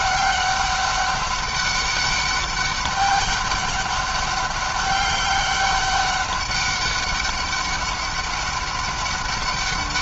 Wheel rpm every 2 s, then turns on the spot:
190, 200, 200, 200, 200.
none